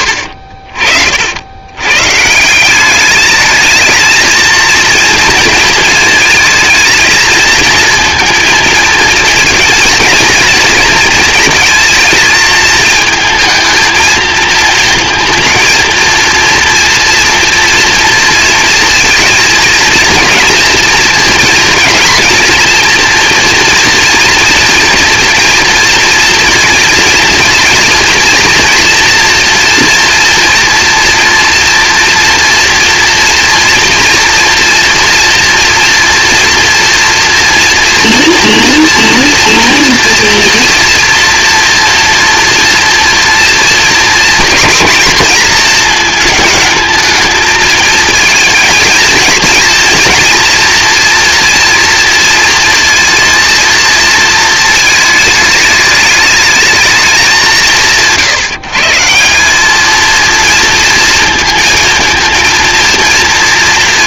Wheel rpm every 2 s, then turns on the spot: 50, 200, 230, 220, 220, 230, 220, 220, 230, 230, 230, 230, 240, 240, 230, 230, 240, 230, 230, 240, 230, 230, 240, 220, 230, 240, 230, 220, 210, 160, 230, 230.
none